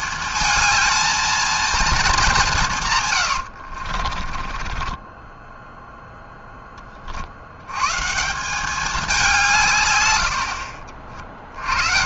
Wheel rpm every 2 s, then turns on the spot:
230, 110, 20, 60, 180, 40.
2-6 10-12